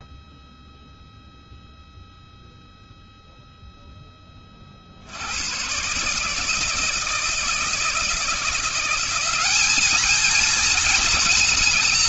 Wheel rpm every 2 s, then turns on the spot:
0, 0, 30, 150, 170, 220.
none